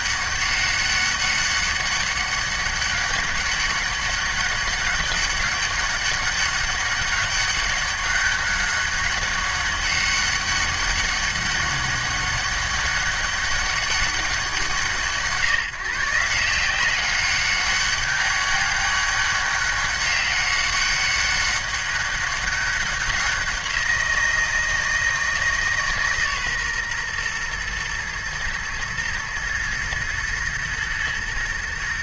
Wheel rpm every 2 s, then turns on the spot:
200, 200, 200, 200, 200, 200, 200, 170, 180, 200, 200, 200, 170, 130, 110, 120.
none